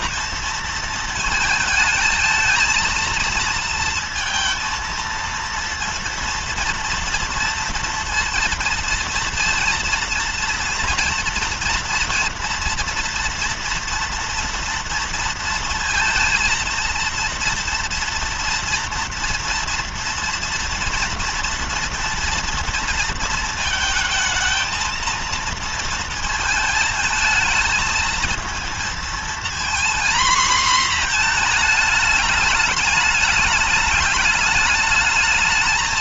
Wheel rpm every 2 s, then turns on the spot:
230, 220, 230, 230, 230, 230, 230, 230, 230, 230, 230, 240, 220, 230, 220, 230, 220, 210.
none